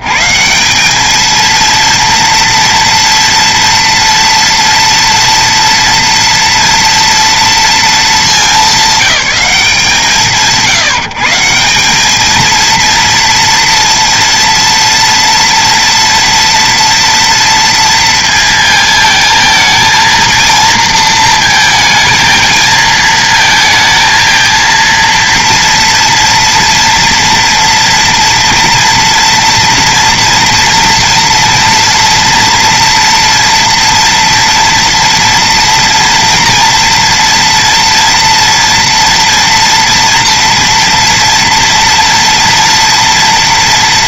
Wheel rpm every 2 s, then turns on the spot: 80, 230, 240, 230, 220, 140, 220, 230, 230, 230, 230, 220, 230, 230, 230, 240, 230, 230, 240, 230, 230, 230.
none